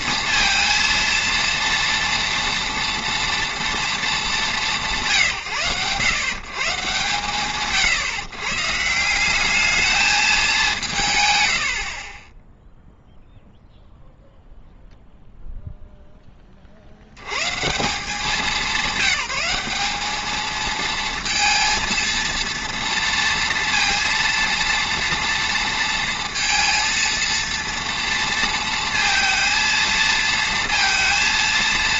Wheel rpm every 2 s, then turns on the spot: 230, 230, 200, 130, 130, 220, 0, 0, 30, 190, 220, 240, 240, 230, 230, 230.
none